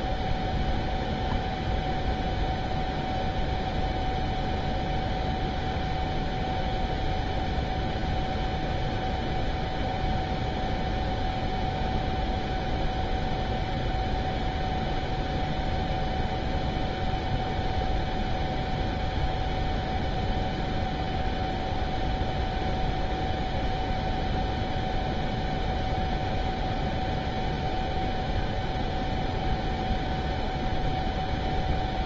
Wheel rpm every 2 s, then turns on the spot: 0, 0, 0, 0, 0, 0, 0, 0, 0, 0, 0, 0, 0, 0, 0, 0.
none